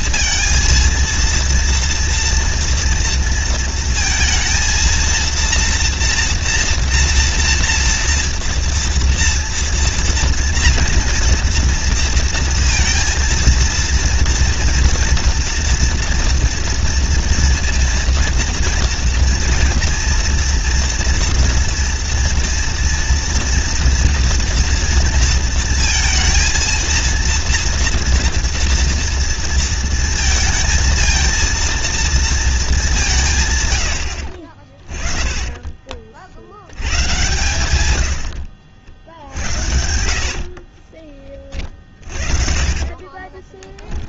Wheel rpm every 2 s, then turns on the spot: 230, 230, 230, 240, 230, 230, 230, 230, 230, 230, 230, 230, 230, 230, 230, 230, 200, 40, 80, 70, 40, 30.
38-44